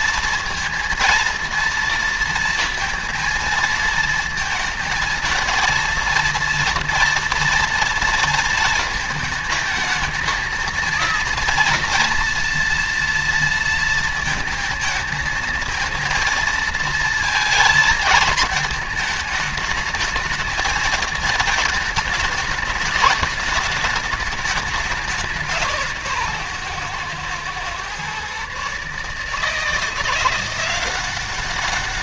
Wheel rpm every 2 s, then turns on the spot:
230, 230, 230, 230, 220, 230, 230, 220, 220, 220, 220, 210, 190, 130, 150, 190.
none